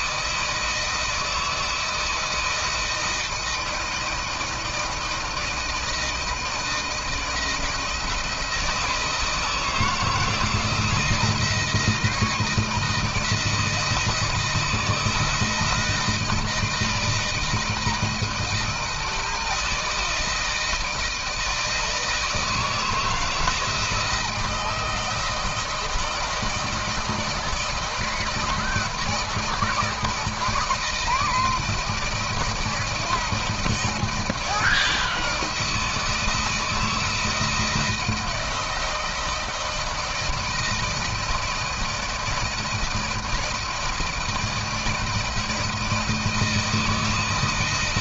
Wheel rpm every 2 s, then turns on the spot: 160, 160, 160, 160, 170, 160, 160, 160, 160, 160, 160, 160, 160, 160, 160, 160, 170, 160, 160, 160, 160, 160, 160, 160.
none